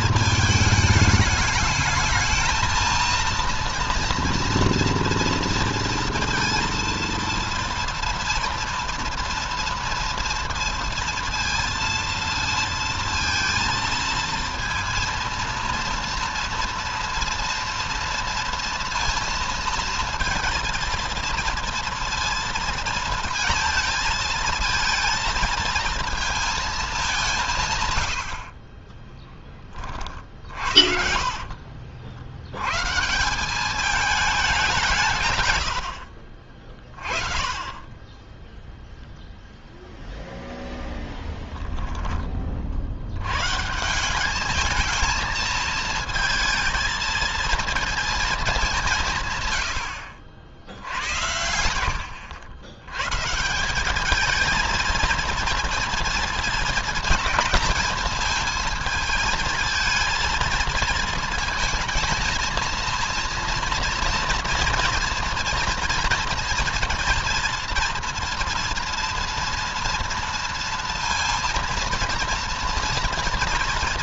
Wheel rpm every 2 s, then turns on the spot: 210, 230, 230, 230, 240, 230, 230, 230, 230, 230, 230, 230, 230, 190, 20, 70, 130, 170, 30, 0, 10, 60, 220, 220, 170, 90, 110, 230, 220, 220, 220, 230, 240, 230, 230, 230, 230.
28-32